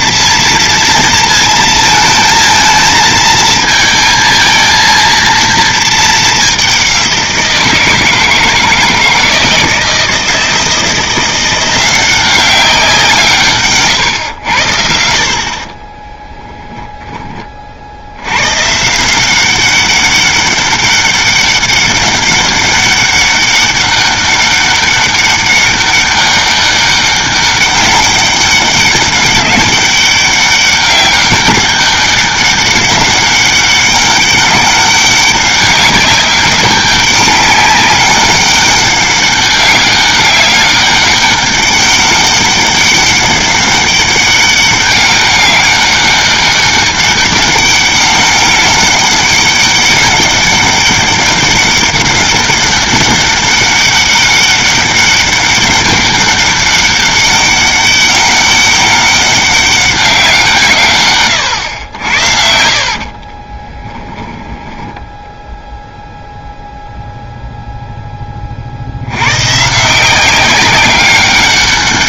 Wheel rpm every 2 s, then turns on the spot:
230, 220, 230, 190, 160, 170, 190, 80, 0, 130, 200, 200, 200, 200, 200, 200, 200, 200, 200, 200, 200, 200, 200, 200, 200, 200, 200, 200, 200, 200, 150, 60, 10, 0, 70, 190.
62-64